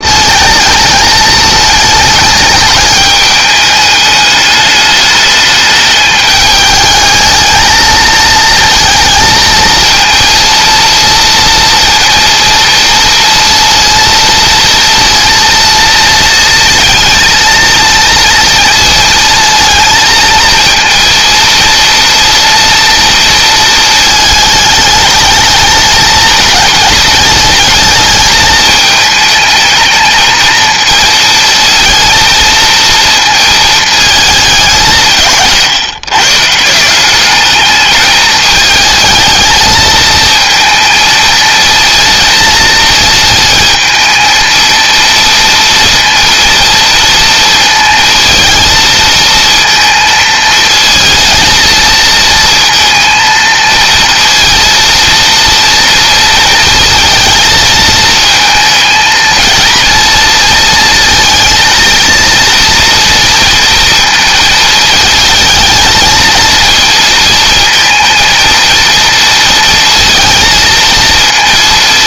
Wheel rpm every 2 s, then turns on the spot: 220, 210, 210, 210, 230, 230, 230, 230, 230, 230, 230, 240, 210, 210, 220, 230, 230, 190, 180, 220, 230, 230, 230, 230, 230, 220, 230, 230, 230, 230, 230, 230, 220, 230, 230, 230.
none